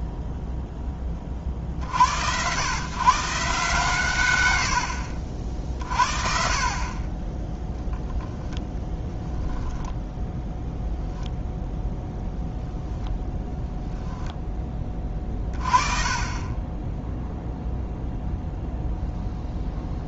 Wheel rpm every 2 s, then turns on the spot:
70, 130, 50, 0, 10, 0, 0, 30, 0, 0.
8-10